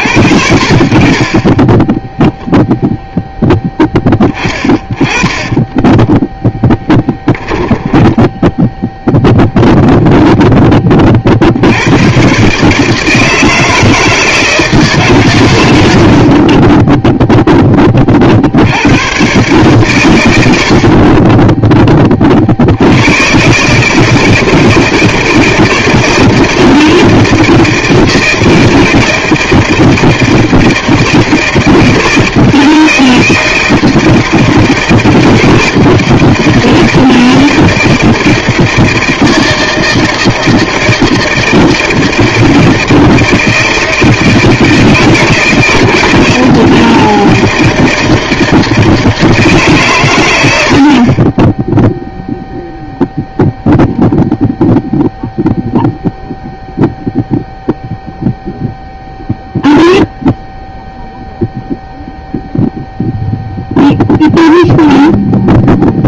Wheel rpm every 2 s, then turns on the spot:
50, 0, 20, 10, 10, 20, 150, 150, 20, 90, 60, 70, 160, 170, 160, 160, 160, 160, 160, 160, 160, 160, 160, 160, 160, 60, 0, 0, 0, 0, 0, 0, 0.
4-8 16-18